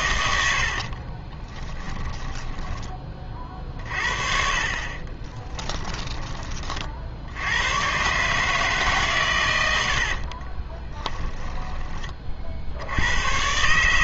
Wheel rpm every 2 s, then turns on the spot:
70, 10, 40, 30, 150, 30, 60.
0-4 10-12